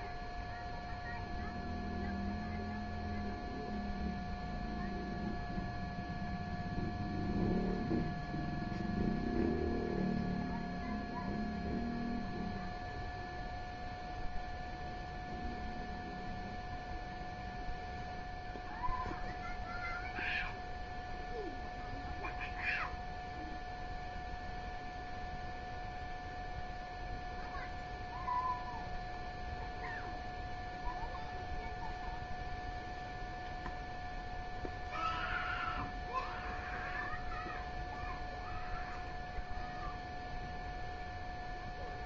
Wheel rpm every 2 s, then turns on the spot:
0, 0, 0, 0, 0, 0, 0, 0, 0, 0, 0, 0, 0, 0, 0, 0, 0, 0, 0, 0, 0.
none